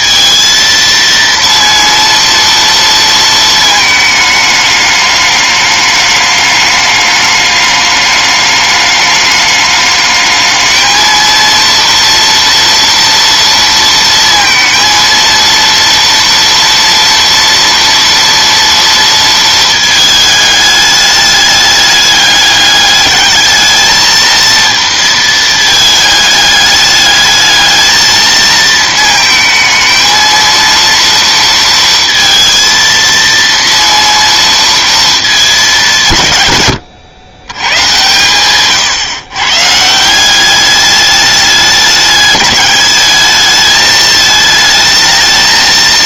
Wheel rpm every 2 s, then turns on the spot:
230, 230, 210, 210, 210, 220, 230, 230, 230, 230, 210, 210, 230, 210, 220, 230, 230, 230, 110, 120, 200, 200, 220.
none